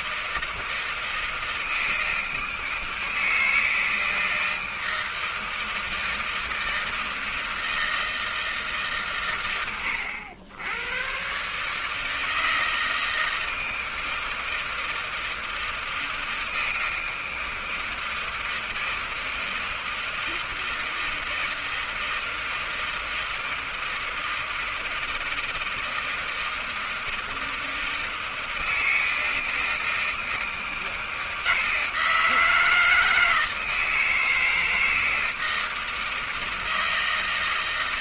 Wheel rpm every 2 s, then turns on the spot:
160, 160, 160, 160, 160, 90, 150, 160, 160, 160, 160, 160, 160, 160, 160, 160, 160, 160, 160.
none